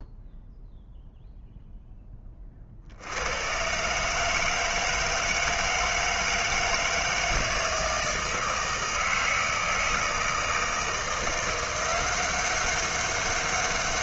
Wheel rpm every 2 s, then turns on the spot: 0, 40, 160, 160, 160, 160, 190.
none